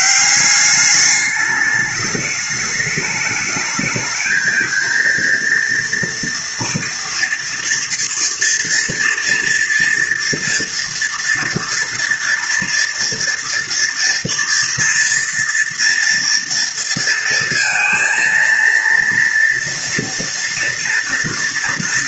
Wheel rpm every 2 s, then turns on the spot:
200, 210, 220, 230, 230, 230, 230, 230, 230, 230, 230.
none